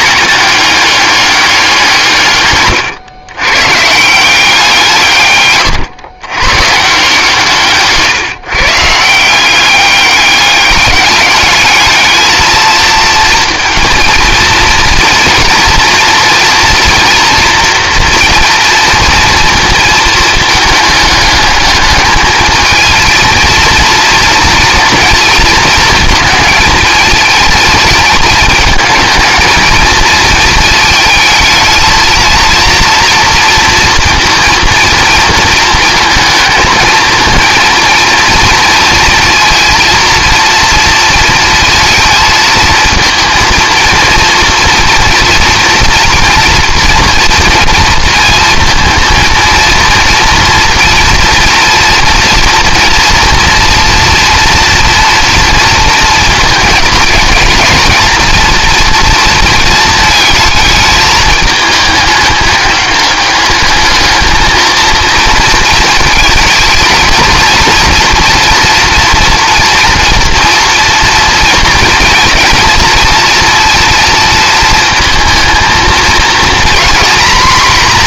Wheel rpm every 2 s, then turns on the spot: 190, 150, 180, 120, 140, 200, 220, 230, 230, 230, 220, 220, 230, 220, 220, 220, 230, 230, 220, 230, 230, 220, 230, 240, 230, 230, 240, 230, 220, 230, 220, 210, 220, 220, 230, 240, 230, 230, 230.
none